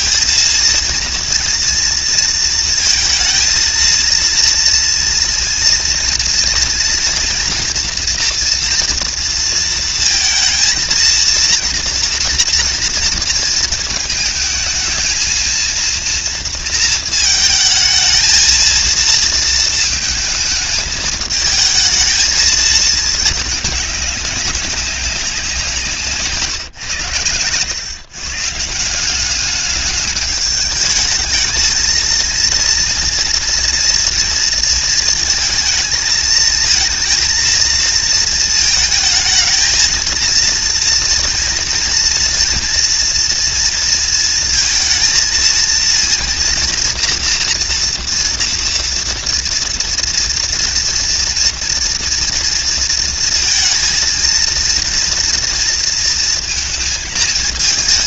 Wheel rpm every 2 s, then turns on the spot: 230, 220, 240, 240, 240, 230, 230, 220, 230, 230, 220, 220, 200, 120, 170, 210, 230, 230, 220, 220, 230, 240, 230, 230, 230, 240, 230, 230, 230.
none